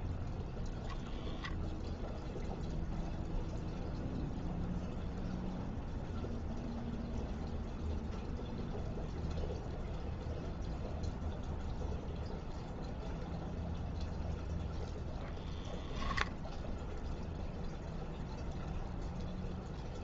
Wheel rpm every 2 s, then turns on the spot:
0, 0, 0, 0, 0, 0, 0, 0, 0, 0.
none